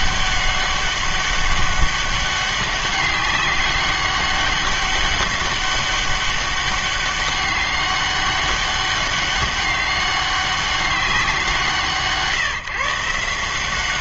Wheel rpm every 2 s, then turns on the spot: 200, 200, 200, 200, 200, 200, 150.
none